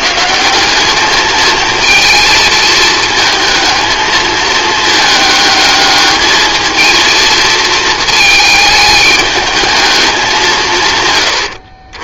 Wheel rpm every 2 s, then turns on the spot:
210, 220, 220, 230, 210, 150.
none